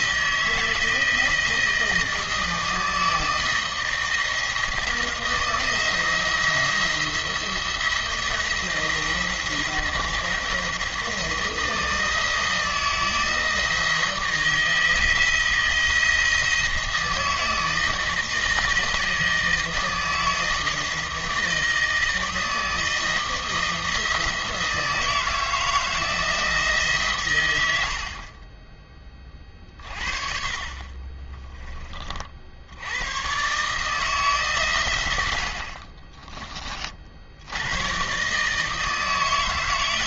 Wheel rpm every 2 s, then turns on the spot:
160, 160, 160, 170, 170, 160, 160, 160, 160, 160, 160, 160, 160, 150, 20, 30, 80, 130, 30, 160.
28-30